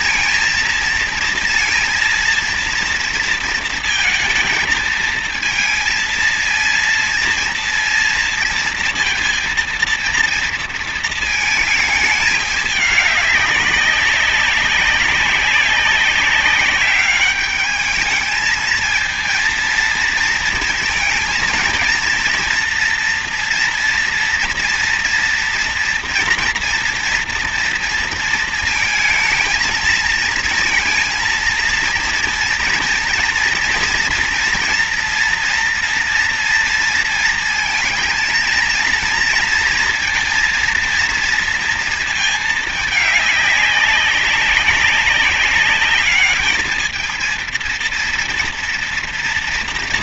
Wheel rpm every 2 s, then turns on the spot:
230, 230, 220, 230, 230, 230, 210, 190, 190, 220, 230, 230, 230, 230, 230, 230, 230, 240, 230, 230, 230, 220, 200, 210, 230.
none